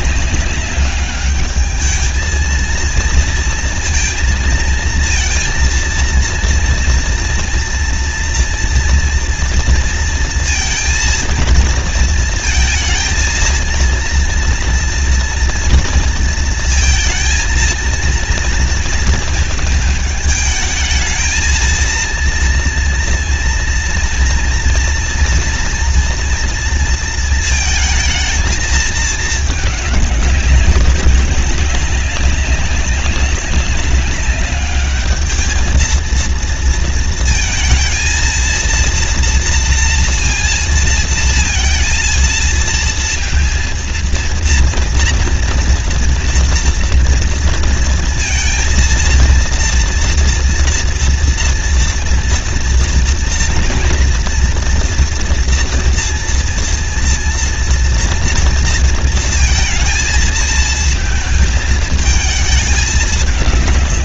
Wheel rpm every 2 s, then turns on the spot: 200, 230, 230, 230, 230, 230, 230, 230, 230, 230, 220, 230, 230, 230, 220, 200, 190, 200, 230, 230, 230, 230, 230, 230, 230, 230, 230, 230, 230, 230, 230, 210.
none